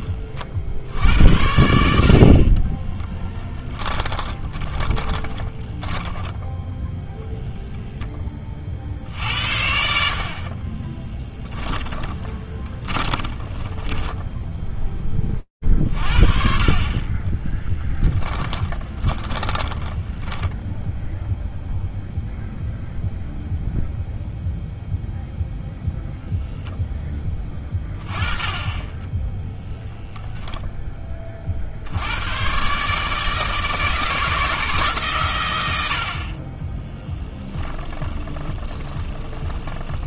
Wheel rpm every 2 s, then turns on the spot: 60, 20, 20, 0, 50, 30, 20, 20, 30, 20, 0, 0, 0, 0, 10, 10, 130, 140, 10, 20.
2-6 10-14 18-20 36-40